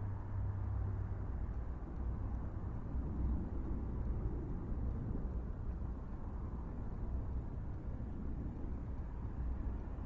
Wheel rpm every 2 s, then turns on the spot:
0, 0, 0, 0, 0.
none